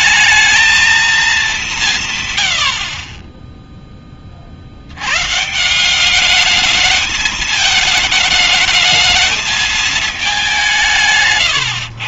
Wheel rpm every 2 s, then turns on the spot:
220, 130, 60, 210, 220, 190.
none